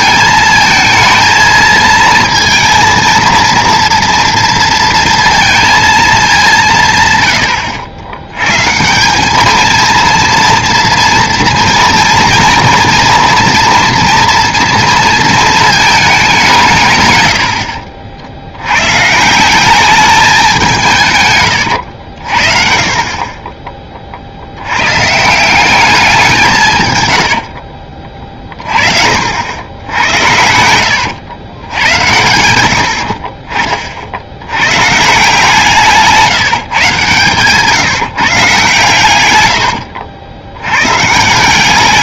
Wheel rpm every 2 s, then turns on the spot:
220, 230, 230, 170, 150, 230, 230, 230, 160, 100, 170, 50, 100, 160, 40, 90, 80, 130, 150, 140, 90.
30-32